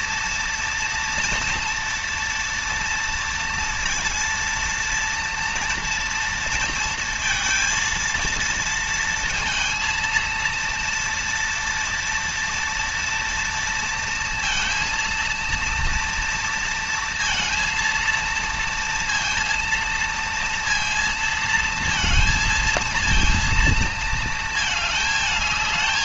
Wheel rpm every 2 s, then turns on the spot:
230, 230, 230, 230, 230, 230, 230, 230, 230, 230, 230, 230, 220.
none